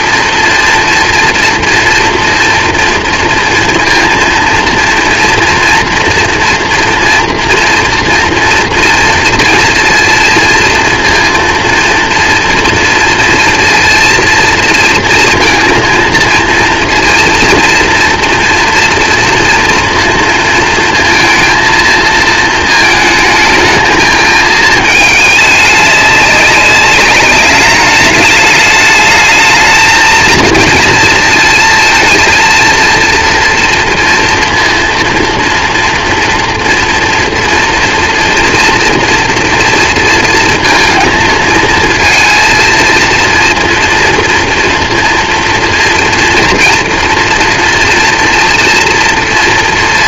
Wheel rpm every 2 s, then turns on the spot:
230, 230, 230, 230, 230, 230, 230, 230, 230, 230, 230, 220, 220, 200, 210, 230, 230, 230, 230, 230, 230, 230, 230, 230, 230.
none